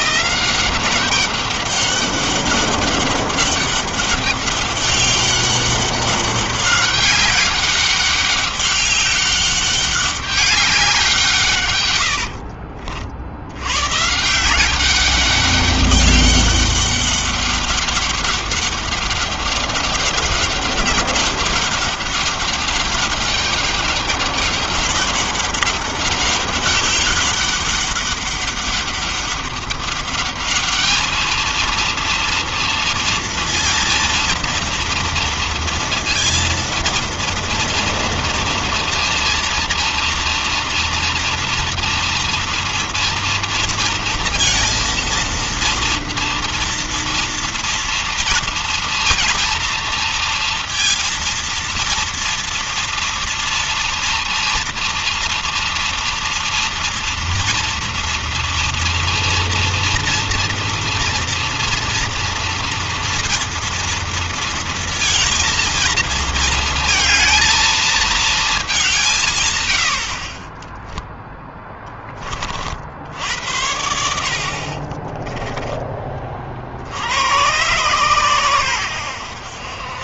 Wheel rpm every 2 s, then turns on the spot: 180, 200, 200, 200, 200, 200, 70, 160, 200, 200, 200, 200, 200, 200, 200, 210, 230, 230, 230, 230, 230, 230, 230, 230, 230, 230, 230, 230, 230, 230, 230, 230, 230, 230, 220, 40, 30, 60, 40, 120.
12-14